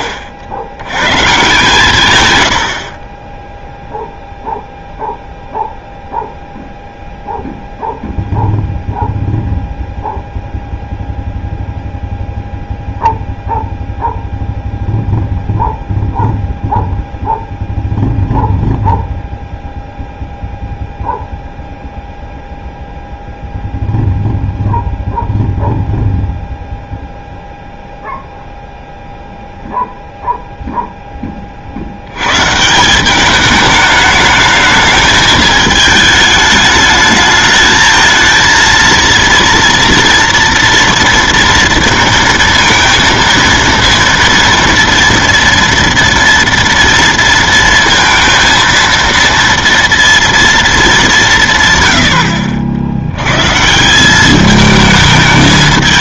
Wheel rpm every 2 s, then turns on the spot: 60, 130, 0, 0, 0, 0, 0, 0, 0, 0, 0, 0, 0, 0, 0, 0, 110, 210, 210, 230, 240, 230, 230, 230, 230, 230, 80, 200.
none